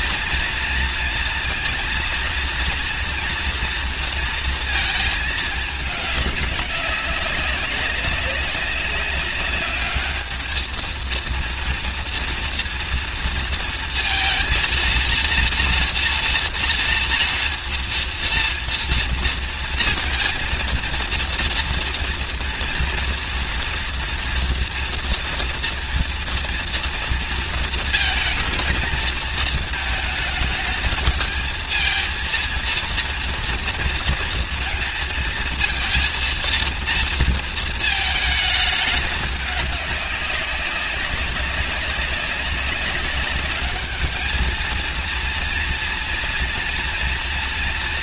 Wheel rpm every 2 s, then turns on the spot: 230, 230, 220, 200, 200, 220, 230, 230, 230, 230, 230, 240, 240, 230, 230, 210, 230, 230, 230, 210, 200, 200, 220, 230.
none